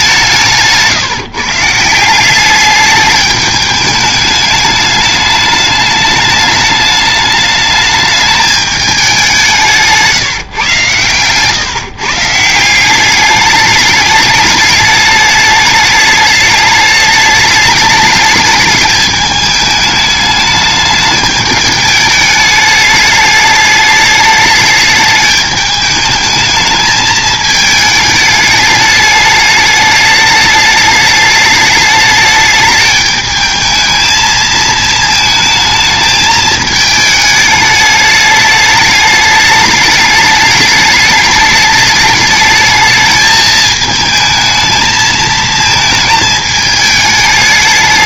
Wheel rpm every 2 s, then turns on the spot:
150, 210, 210, 210, 210, 130, 180, 210, 210, 210, 210, 210, 210, 220, 210, 210, 210, 220, 220, 210, 210, 220, 220, 210.
none